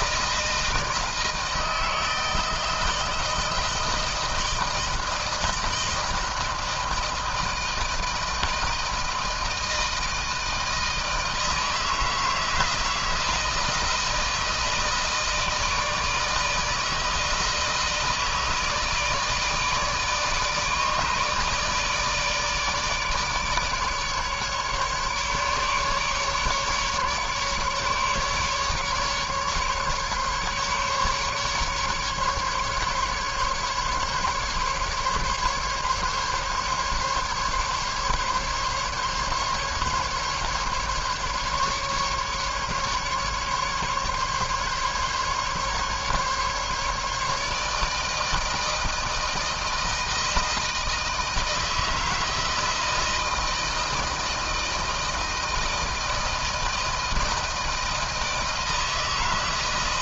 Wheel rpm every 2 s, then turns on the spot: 160, 160, 160, 160, 160, 160, 160, 160, 160, 160, 150, 150, 150, 150, 150, 140, 140, 140, 140, 140, 150, 140, 140, 150, 160, 160, 160, 160, 160, 160.
none